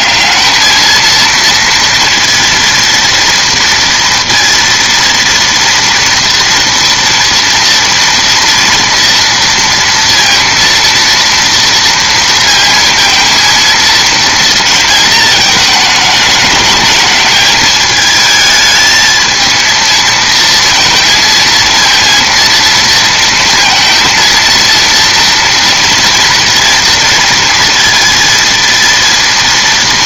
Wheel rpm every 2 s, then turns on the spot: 210, 230, 230, 230, 230, 230, 230, 230, 210, 220, 230, 230, 230, 230, 230.
none